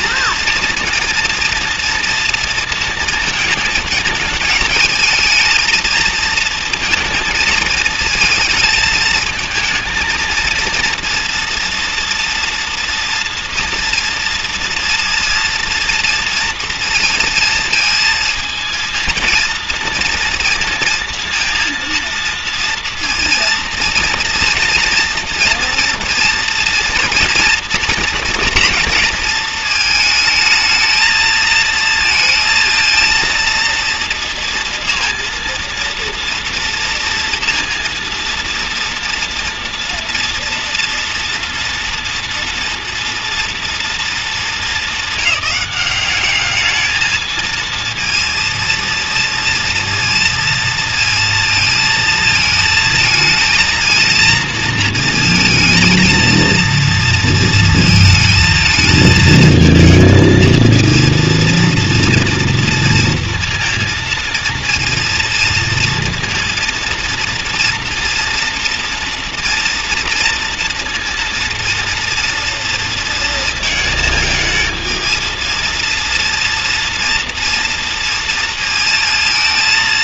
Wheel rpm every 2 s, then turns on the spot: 230, 230, 220, 230, 220, 230, 230, 230, 230, 230, 230, 230, 240, 240, 230, 220, 230, 230, 230, 230, 230, 230, 220, 210, 230, 230, 220, 230, 230, 230, 230, 230, 230, 230, 230, 230, 230, 220, 230, 230.
none